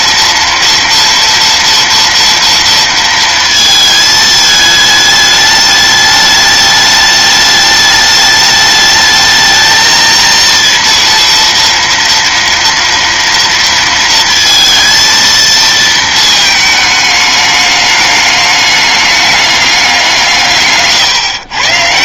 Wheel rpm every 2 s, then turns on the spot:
230, 230, 220, 210, 210, 230, 230, 230, 220, 210, 150.
none